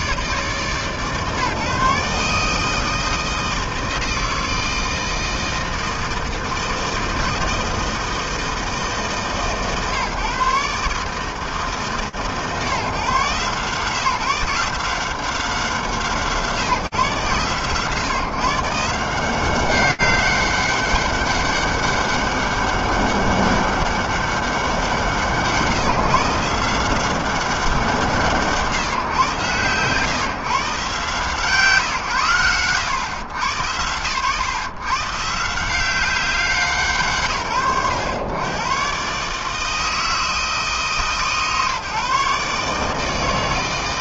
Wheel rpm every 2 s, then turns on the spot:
150, 160, 160, 160, 160, 140, 130, 160, 150, 140, 190, 200, 180, 170, 150, 130, 90, 130, 190, 110, 150, 150.
none